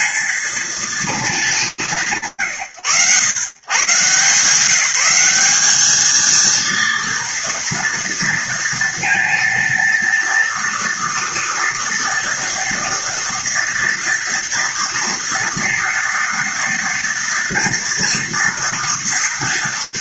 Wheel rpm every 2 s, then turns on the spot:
230, 140, 150, 230, 230, 230, 230, 240, 230, 230.
none